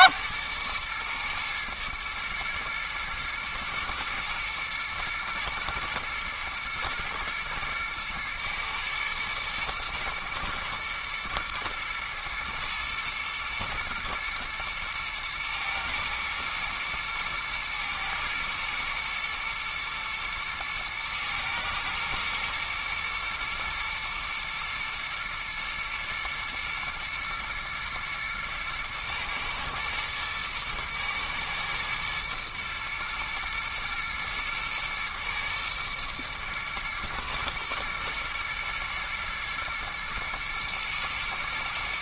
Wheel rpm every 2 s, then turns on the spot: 110, 110, 120, 110, 110, 110, 120, 120, 120, 120, 110, 120, 120, 110, 110, 120, 110, 120, 120, 120, 110.
none